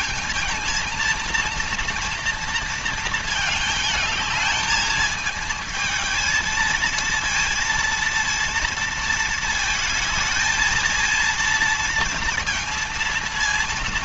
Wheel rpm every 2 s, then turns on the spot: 230, 230, 220, 220, 230, 220, 230.
none